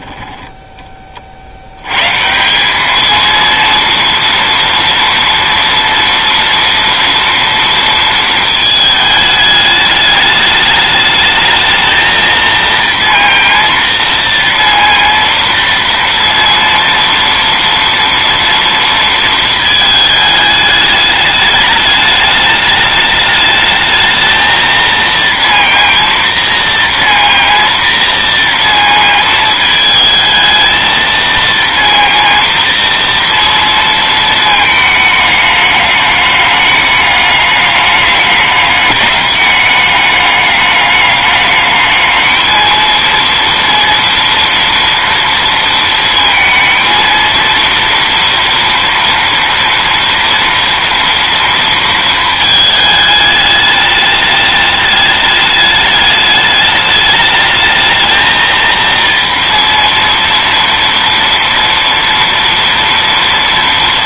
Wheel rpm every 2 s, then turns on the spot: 20, 200, 230, 240, 220, 210, 230, 230, 230, 230, 210, 210, 230, 230, 230, 220, 230, 220, 210, 210, 210, 230, 230, 230, 230, 230, 220, 210, 210, 230, 230, 230.
none